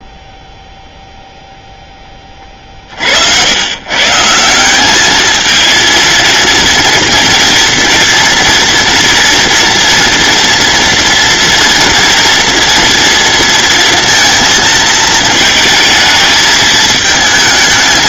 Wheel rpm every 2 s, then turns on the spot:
0, 50, 200, 230, 230, 230, 230, 220, 220.
none